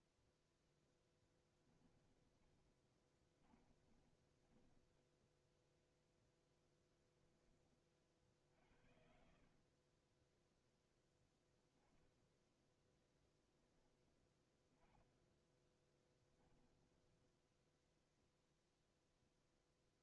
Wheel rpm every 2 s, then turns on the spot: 0, 20, 10, 10, 60, 0, 0, 10, 10, 0.
2-6 16-18